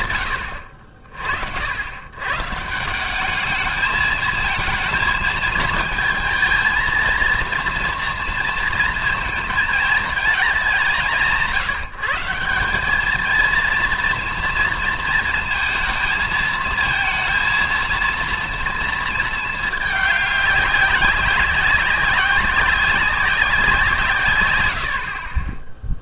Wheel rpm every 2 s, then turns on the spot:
50, 210, 220, 230, 230, 170, 220, 230, 230, 220, 190, 190, 30.
none